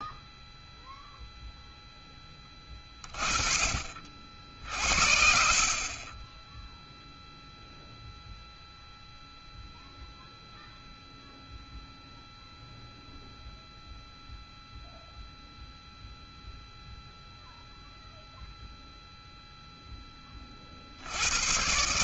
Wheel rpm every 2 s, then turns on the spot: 0, 20, 50, 10, 0, 0, 0, 0, 0, 0, 30.
none